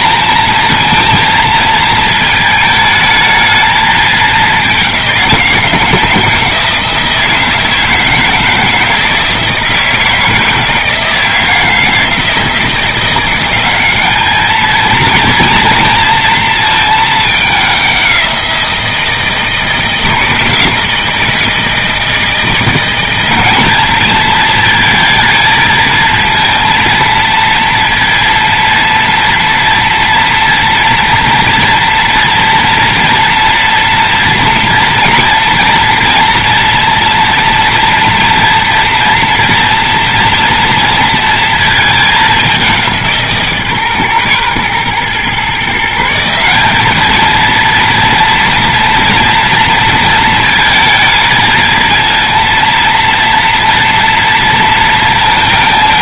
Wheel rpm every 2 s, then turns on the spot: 230, 220, 190, 160, 160, 160, 170, 230, 220, 170, 160, 190, 230, 230, 230, 240, 240, 230, 230, 240, 230, 180, 120, 200, 230, 220, 230, 230.
none